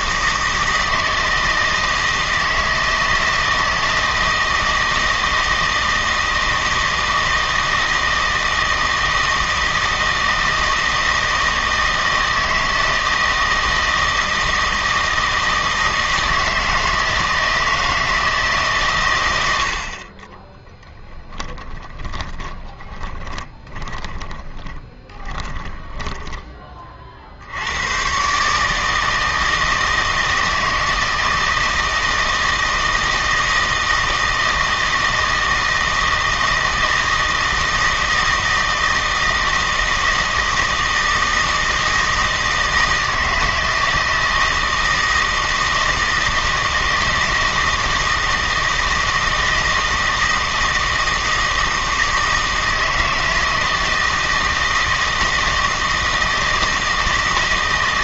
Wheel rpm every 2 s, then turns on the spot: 160, 160, 160, 160, 160, 160, 160, 160, 160, 140, 10, 30, 20, 30, 150, 160, 160, 160, 160, 160, 160, 160, 160, 160, 160, 160, 160, 160, 160.
20-26